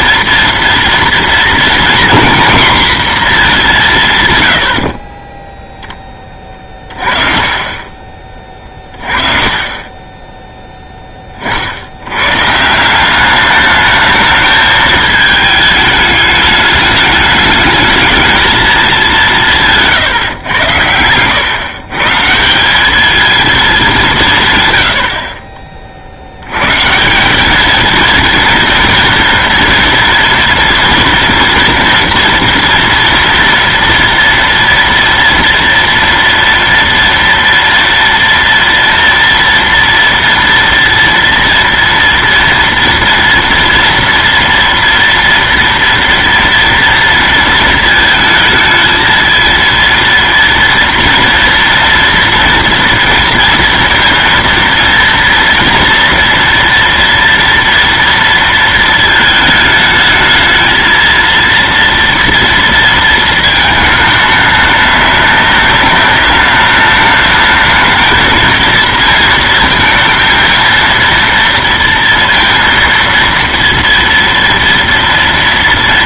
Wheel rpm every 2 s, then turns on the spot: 230, 240, 80, 30, 30, 10, 160, 220, 210, 210, 110, 190, 120, 120, 230, 230, 230, 230, 230, 230, 230, 230, 240, 230, 220, 230, 230, 230, 230, 220, 220, 230, 210, 200, 220, 230, 230, 230.
20-22